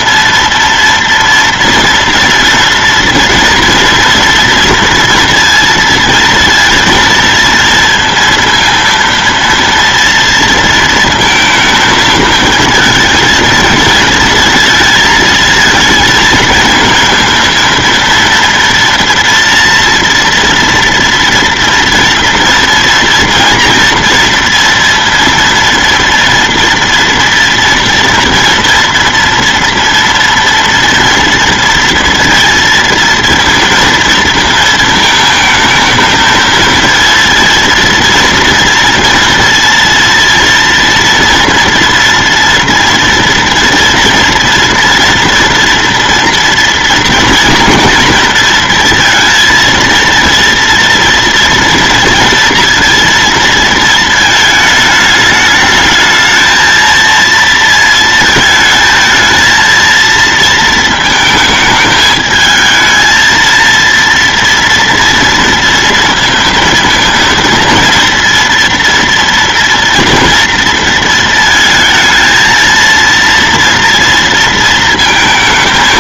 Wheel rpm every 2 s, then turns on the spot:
230, 230, 230, 230, 230, 230, 220, 220, 220, 230, 230, 230, 230, 240, 230, 230, 230, 230, 230, 230, 230, 230, 230, 230, 230, 230, 230, 210, 230, 220, 220, 220, 230, 230, 230, 230, 230, 230.
none